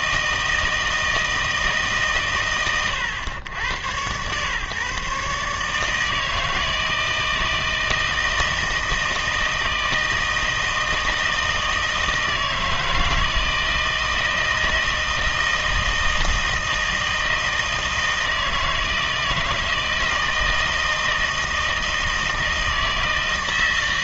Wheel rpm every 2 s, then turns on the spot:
160, 110, 130, 160, 160, 160, 160, 160, 160, 160, 160, 160.
none